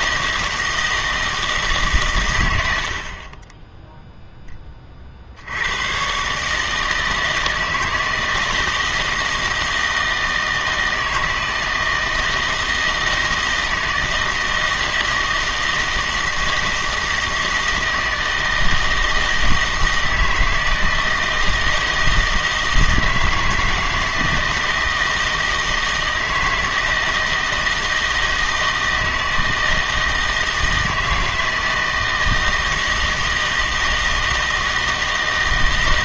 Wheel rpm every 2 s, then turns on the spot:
160, 70, 20, 150, 160, 160, 160, 160, 160, 160, 160, 160, 160, 160, 160, 160, 160, 160.
none